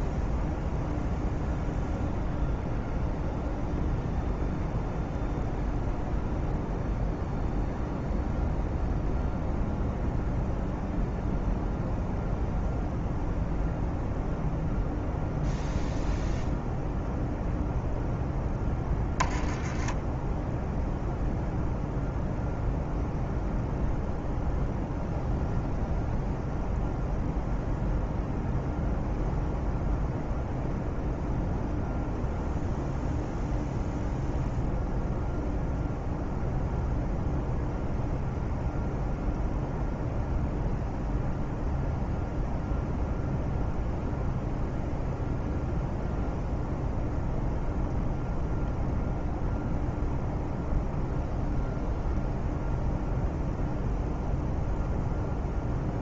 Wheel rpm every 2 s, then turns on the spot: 0, 0, 0, 0, 0, 0, 0, 0, 0, 10, 0, 0, 0, 0, 0, 0, 0, 0, 0, 0, 0, 0, 0, 0, 0, 0, 0, 0.
none